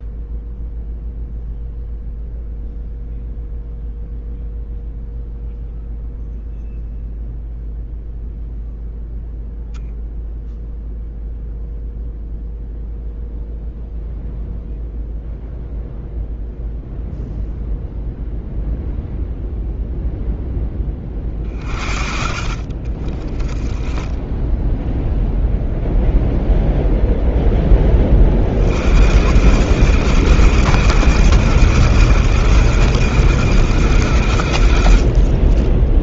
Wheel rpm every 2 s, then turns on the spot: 0, 0, 0, 0, 0, 0, 0, 0, 0, 0, 10, 40, 0, 0, 50, 120, 120, 80.
none